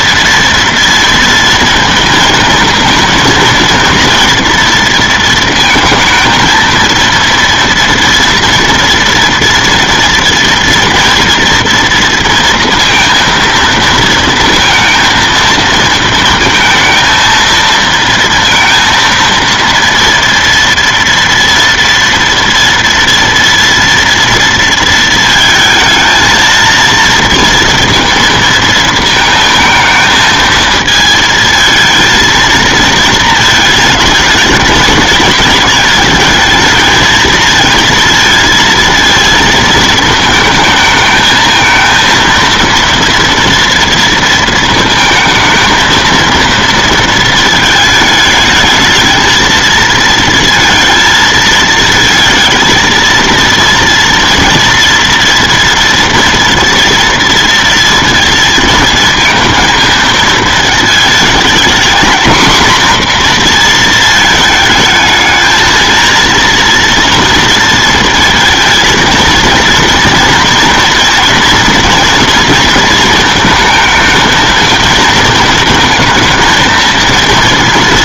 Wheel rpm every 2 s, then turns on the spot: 230, 230, 230, 220, 240, 230, 230, 230, 230, 230, 240, 230, 230, 230, 230, 220, 230, 220, 220, 230, 220, 230, 230, 230, 220, 230, 230, 230, 240, 220, 220, 240, 220, 230, 230, 230, 230, 230, 220.
none